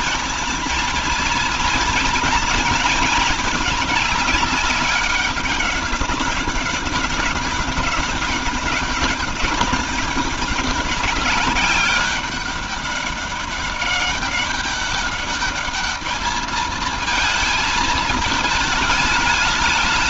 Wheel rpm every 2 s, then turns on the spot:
220, 220, 200, 200, 190, 200, 200, 200, 220, 210.
none